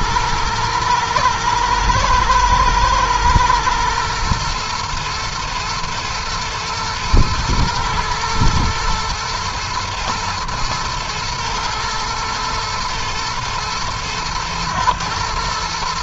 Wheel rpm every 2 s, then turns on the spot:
110, 120, 110, 110, 110, 110, 110, 110.
none